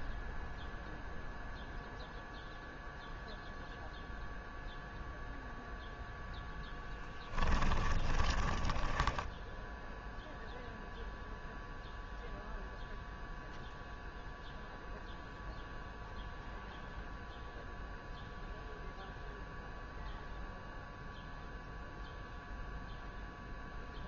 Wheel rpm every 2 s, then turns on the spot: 0, 0, 0, 0, 20, 0, 0, 0, 0, 0, 0, 0.
8-10